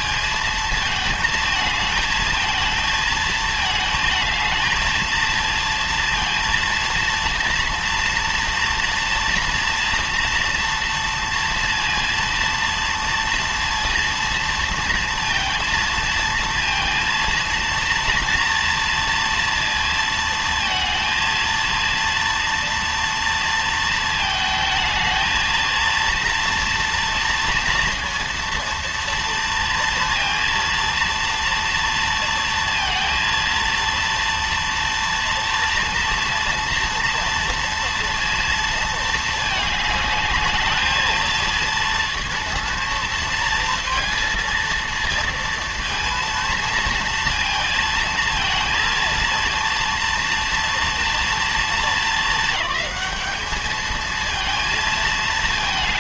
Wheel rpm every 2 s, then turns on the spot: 220, 220, 220, 230, 230, 230, 230, 230, 230, 230, 230, 230, 220, 230, 230, 230, 230, 230, 230, 220, 220, 230, 230, 230, 230, 230, 210, 220.
none